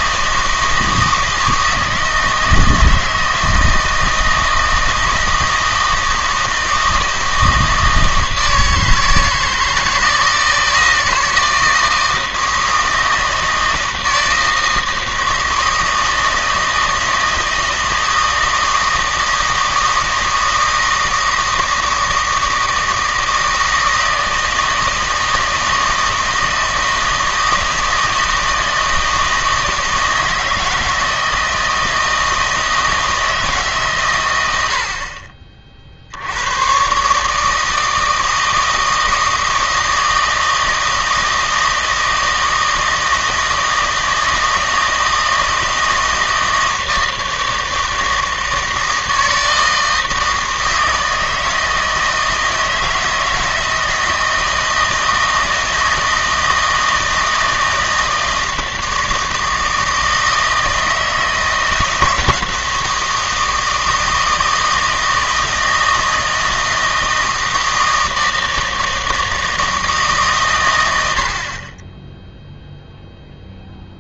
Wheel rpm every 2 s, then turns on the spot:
160, 160, 160, 160, 160, 160, 160, 160, 160, 160, 160, 160, 160, 160, 160, 160, 160, 80, 110, 160, 160, 160, 160, 160, 160, 160, 160, 160, 160, 160, 160, 160, 160, 160, 160, 110, 0.
none